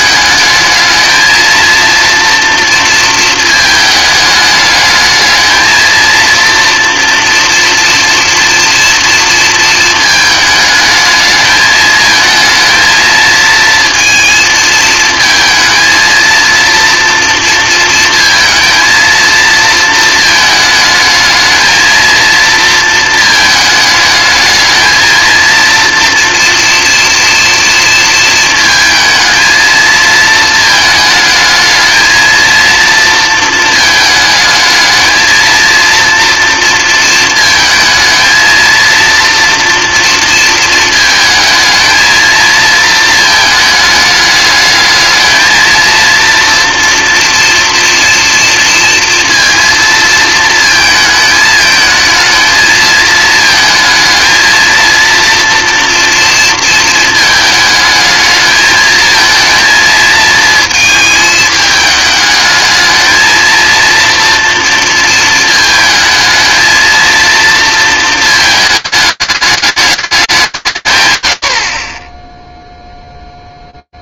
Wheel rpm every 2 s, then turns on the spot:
220, 230, 210, 230, 240, 220, 220, 230, 230, 230, 220, 230, 220, 230, 230, 220, 230, 220, 230, 230, 230, 230, 210, 230, 230, 220, 220, 220, 230, 220, 220, 210, 230, 220, 220, 160, 0.
none